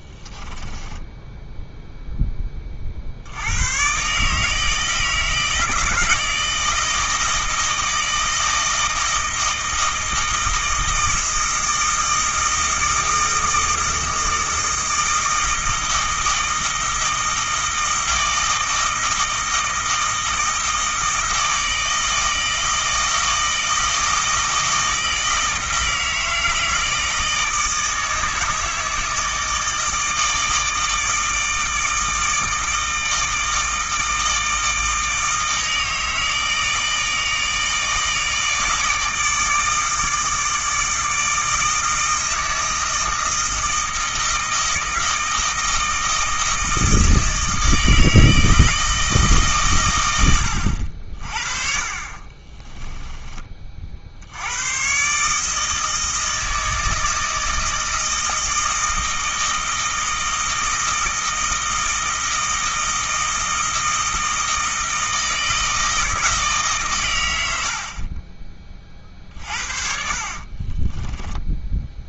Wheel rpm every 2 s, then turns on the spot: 10, 30, 160, 160, 160, 160, 160, 160, 160, 160, 160, 160, 160, 160, 160, 160, 160, 160, 160, 160, 160, 160, 160, 160, 160, 70, 20, 110, 160, 160, 160, 160, 160, 140, 30, 30.
0-2 52-54 70-72